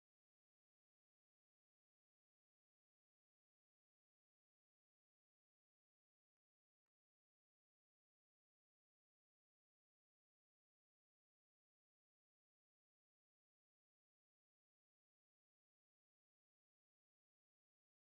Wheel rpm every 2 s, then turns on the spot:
0, 0, 0, 0, 0, 0, 0, 0, 0.
none